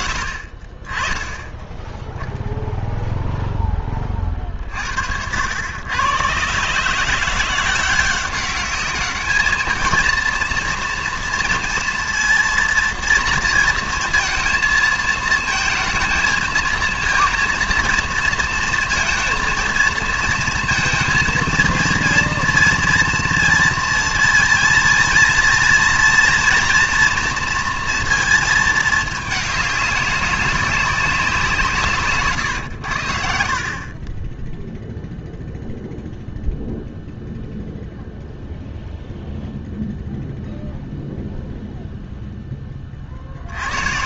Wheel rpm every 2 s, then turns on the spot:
30, 0, 50, 140, 200, 230, 230, 230, 220, 230, 230, 230, 230, 230, 220, 200, 120, 10, 0, 0, 0, 10.
none